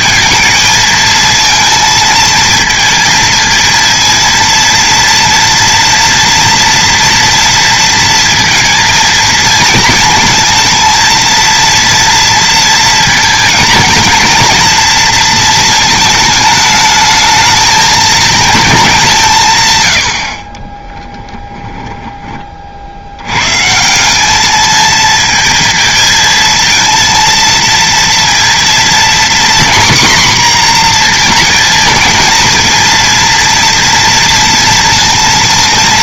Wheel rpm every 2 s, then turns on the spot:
220, 220, 230, 230, 230, 230, 230, 230, 220, 210, 30, 60, 220, 230, 230, 240, 230, 230.
20-22